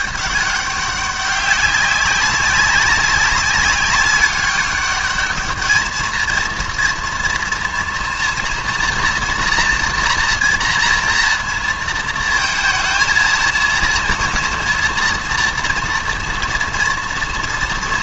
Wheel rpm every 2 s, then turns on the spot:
200, 190, 200, 230, 240, 240, 230, 230, 230.
none